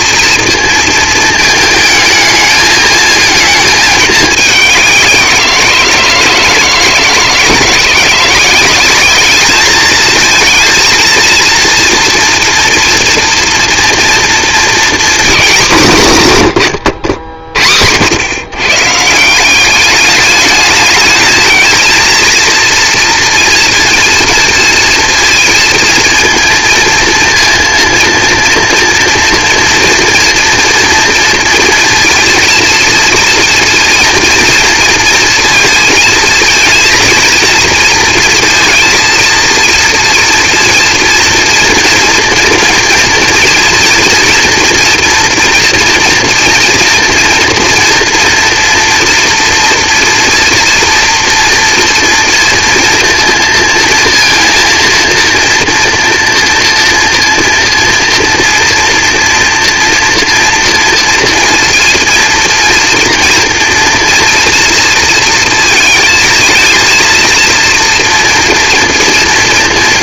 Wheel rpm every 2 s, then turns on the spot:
230, 220, 190, 160, 190, 230, 230, 230, 130, 140, 210, 230, 230, 230, 230, 240, 230, 230, 230, 230, 230, 230, 230, 230, 230, 230, 230, 230, 240, 240, 230, 230, 230, 230, 240.
none